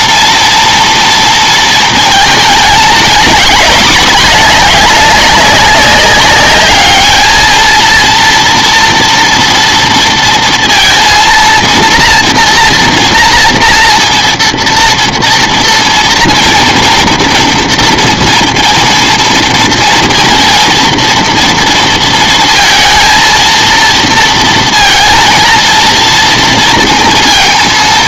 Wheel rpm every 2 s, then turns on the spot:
230, 220, 210, 210, 230, 230, 230, 230, 230, 230, 230, 230, 230, 230.
none